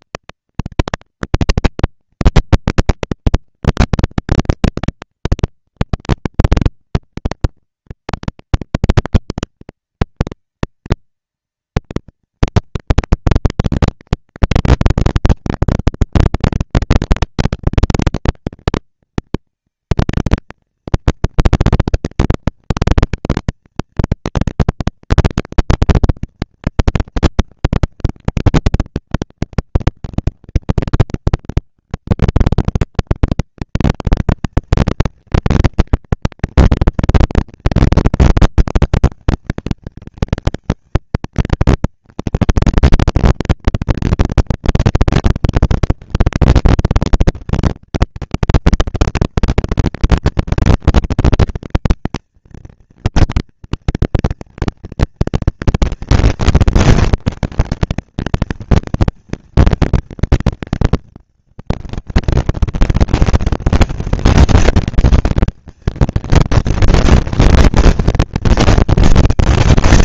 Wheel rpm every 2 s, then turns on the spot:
230, 230, 230, 230, 230, 230, 230, 230, 240, 230, 230, 230, 230, 220, 190, 190, 200, 230, 230, 220, 220, 230, 230, 230, 230, 230, 230, 230, 230, 230, 220, 200, 200, 230, 230.
none